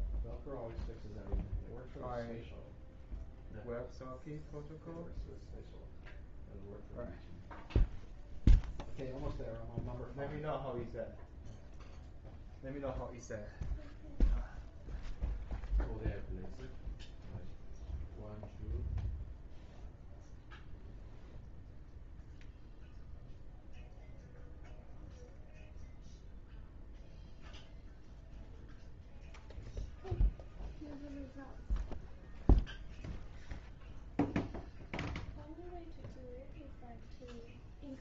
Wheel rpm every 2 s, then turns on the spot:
0, 0, 0, 0, 0, 0, 0, 0, 0, 0, 0, 0, 0, 0, 0, 0, 0, 0, 0.
none